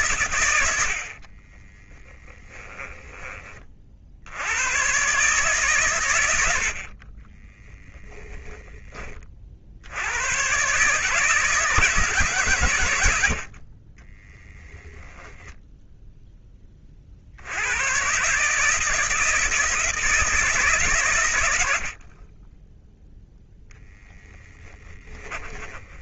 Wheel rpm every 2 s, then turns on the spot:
80, 20, 120, 40, 20, 140, 100, 10, 40, 160, 130, 10, 20.
2-4 24-26